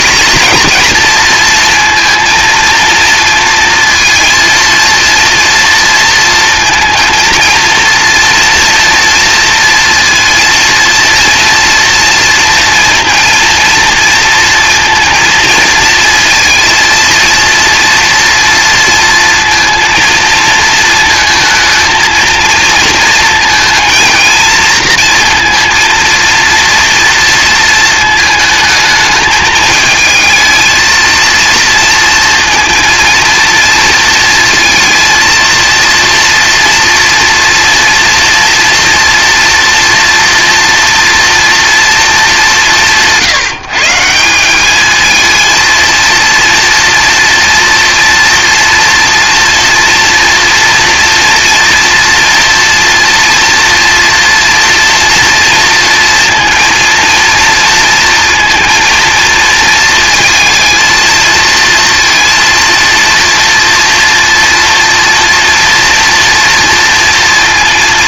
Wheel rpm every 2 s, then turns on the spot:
230, 230, 230, 230, 230, 230, 230, 230, 230, 230, 220, 220, 230, 230, 220, 220, 230, 230, 230, 230, 230, 180, 200, 230, 230, 230, 230, 230, 230, 230, 230, 230, 230, 230.
none